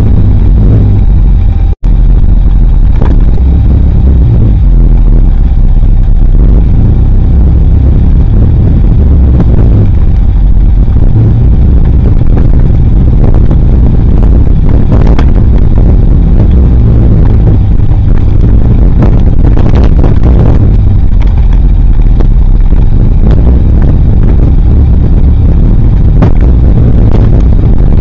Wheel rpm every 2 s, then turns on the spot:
0, 0, 0, 0, 0, 0, 0, 0, 0, 0, 0, 0, 0, 0.
none